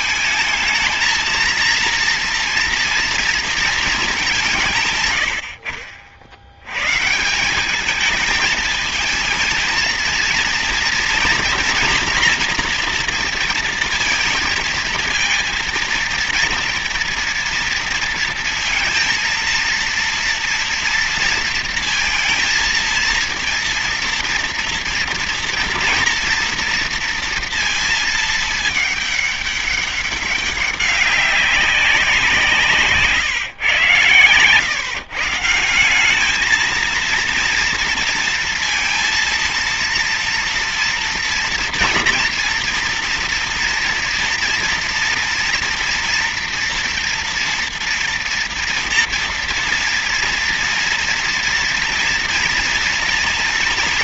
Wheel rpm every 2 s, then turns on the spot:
220, 230, 170, 80, 220, 230, 240, 230, 230, 230, 230, 230, 230, 230, 220, 200, 170, 130, 220, 230, 240, 230, 230, 240, 240, 230, 230.
none